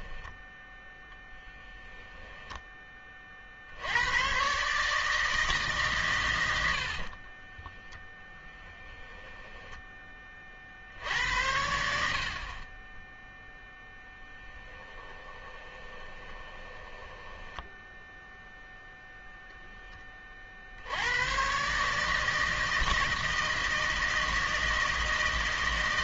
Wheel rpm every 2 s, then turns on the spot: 10, 20, 150, 70, 10, 60, 20, 20, 10, 0, 70, 160, 150.
6-10 14-18